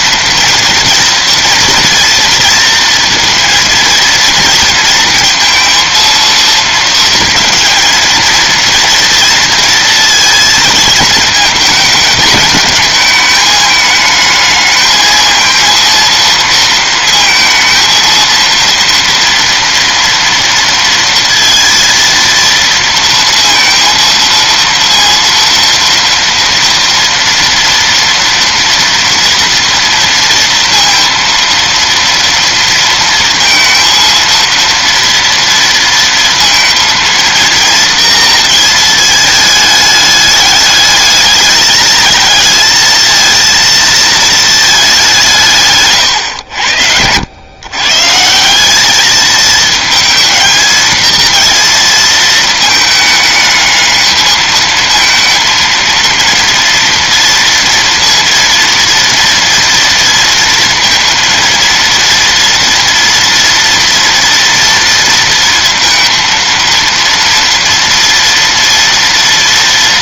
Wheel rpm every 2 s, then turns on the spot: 230, 230, 230, 230, 230, 230, 220, 220, 230, 230, 230, 230, 230, 240, 230, 230, 230, 230, 230, 230, 210, 230, 220, 90, 190, 220, 220, 220, 230, 230, 230, 230, 230, 230, 230.
none